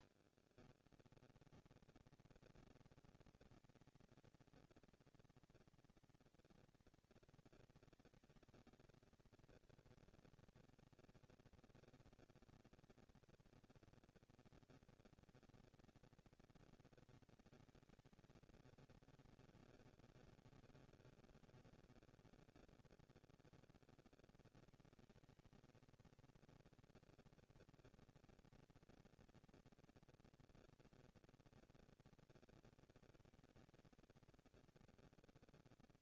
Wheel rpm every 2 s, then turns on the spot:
40, 210, 230, 230, 220, 230, 230, 230, 230, 200, 160, 160, 190, 230, 230, 240, 230, 230.
none